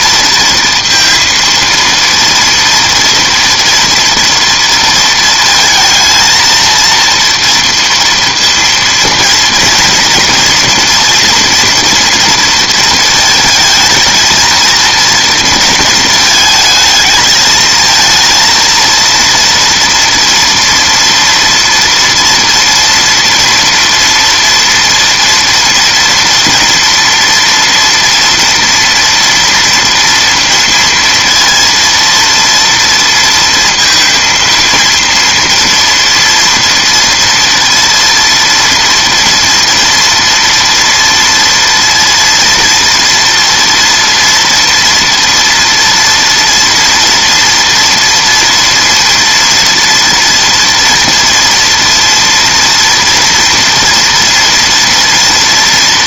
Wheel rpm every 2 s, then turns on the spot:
230, 230, 230, 230, 230, 230, 230, 230, 220, 230, 230, 230, 240, 230, 230, 230, 230, 230, 230, 230, 230, 230, 230, 240, 230, 230, 230, 230.
none